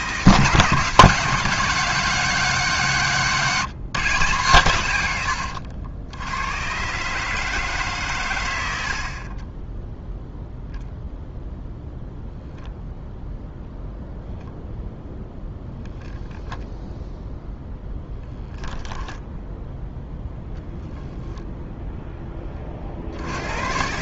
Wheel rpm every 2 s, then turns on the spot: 170, 180, 130, 110, 90, 0, 0, 0, 0, 0, 0, 30.
none